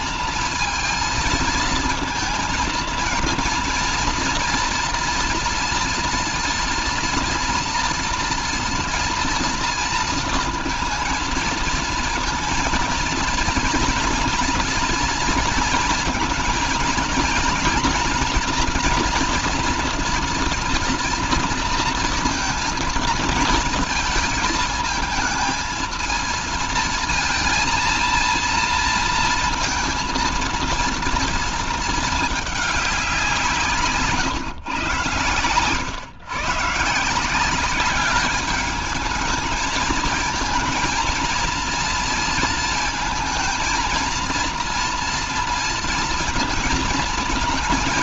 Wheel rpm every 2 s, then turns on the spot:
220, 230, 230, 240, 230, 230, 230, 230, 230, 230, 240, 230, 220, 220, 230, 230, 210, 130, 140, 210, 220, 230, 230, 230.
none